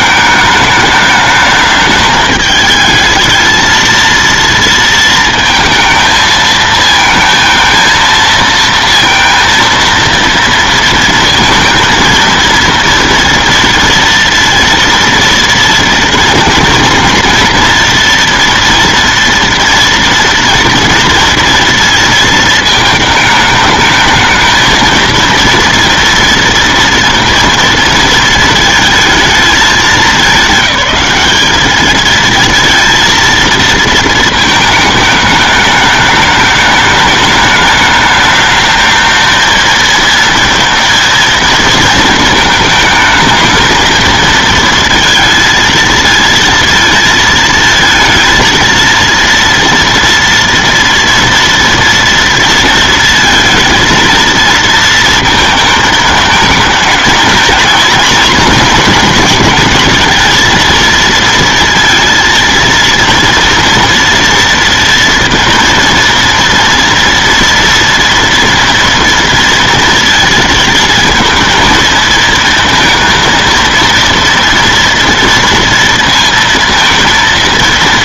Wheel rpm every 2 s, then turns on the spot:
210, 210, 230, 220, 230, 230, 230, 230, 230, 230, 230, 230, 220, 230, 230, 210, 230, 220, 210, 210, 230, 220, 230, 230, 230, 230, 230, 230, 220, 220, 230, 230, 230, 230, 230, 230, 230, 230, 230.
none